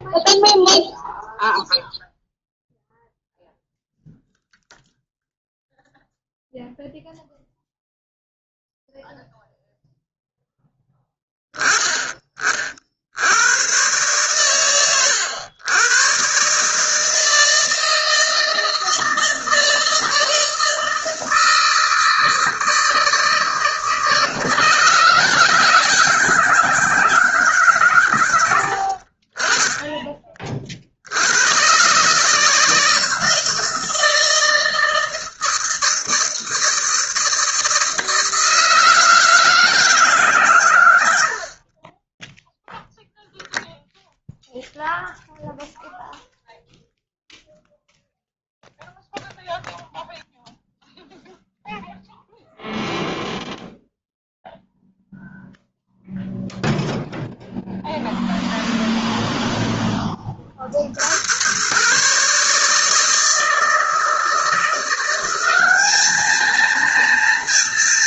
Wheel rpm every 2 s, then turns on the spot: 0, 0, 0, 0, 0, 10, 50, 120, 150, 160, 160, 160, 160, 160, 60, 60, 160, 160, 160, 160, 110, 0, 0, 0, 0, 0, 0, 0, 0, 0, 50, 160, 170, 230.
none